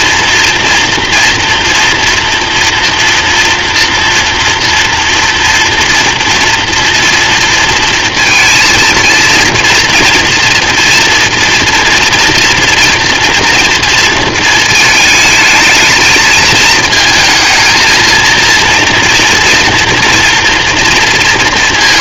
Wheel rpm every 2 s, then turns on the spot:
230, 230, 230, 240, 230, 240, 230, 230, 230, 230, 240.
none